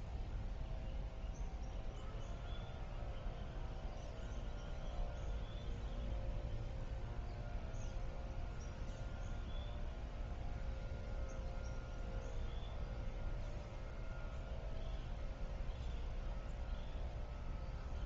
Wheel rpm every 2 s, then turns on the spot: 0, 0, 0, 0, 0, 0, 0, 0, 0.
none